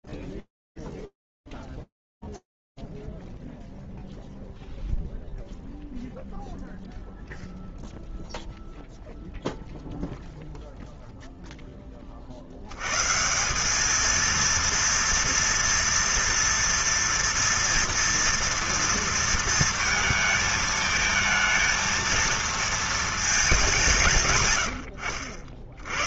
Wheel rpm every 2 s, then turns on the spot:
0, 0, 0, 0, 0, 120, 230, 230, 230, 220, 230, 90, 10.
24-26